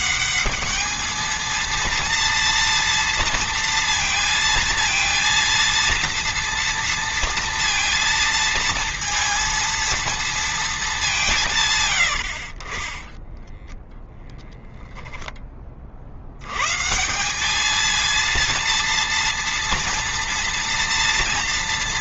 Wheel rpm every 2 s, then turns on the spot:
220, 230, 230, 230, 230, 210, 30, 0, 150, 230, 230.
none